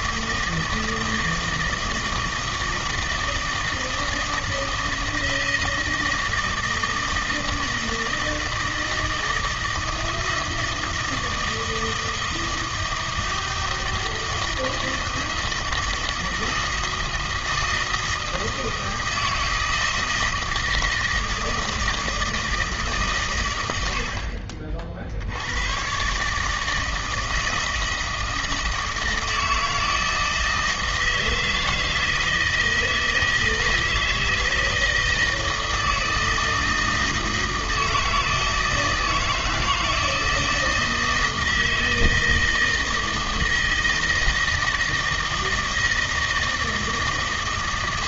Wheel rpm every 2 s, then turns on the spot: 160, 160, 160, 160, 160, 160, 160, 160, 160, 160, 160, 160, 60, 150, 160, 160, 160, 160, 160, 160, 160, 160, 160, 160.
none